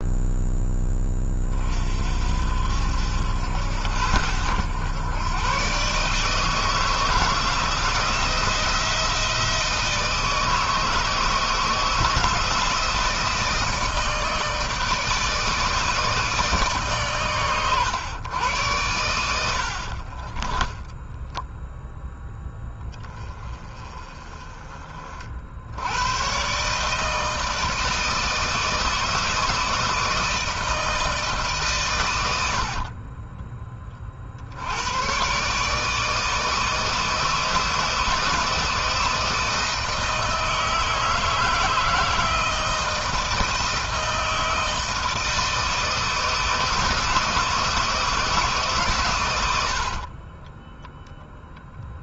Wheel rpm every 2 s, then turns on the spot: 10, 60, 90, 160, 170, 160, 160, 160, 150, 110, 10, 10, 30, 140, 160, 160, 60, 80, 160, 160, 160, 160, 160, 160, 130, 10.
32-34 50-52